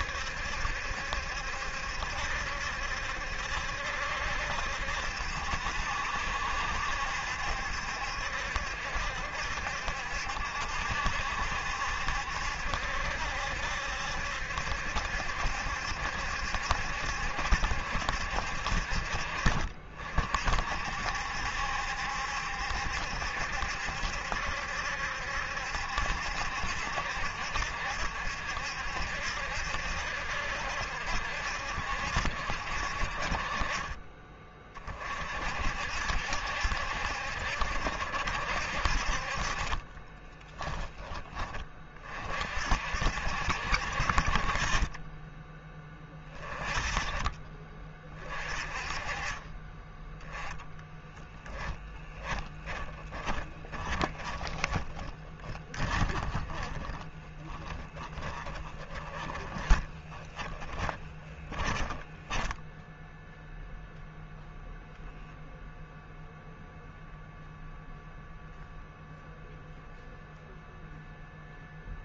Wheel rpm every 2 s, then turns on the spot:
70, 70, 70, 70, 60, 70, 70, 70, 70, 60, 50, 70, 70, 60, 70, 60, 50, 30, 60, 60, 10, 50, 40, 20, 40, 10, 20, 20, 20, 20, 20, 10, 0, 0, 0, 0.
50-64